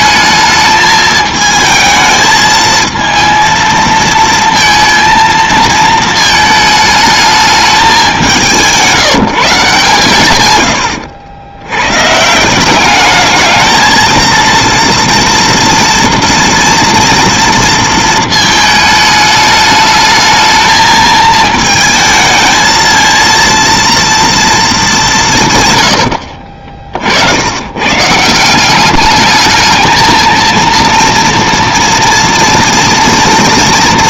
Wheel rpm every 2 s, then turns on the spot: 210, 220, 230, 210, 170, 120, 190, 230, 230, 220, 220, 220, 220, 50, 190, 230, 230.
none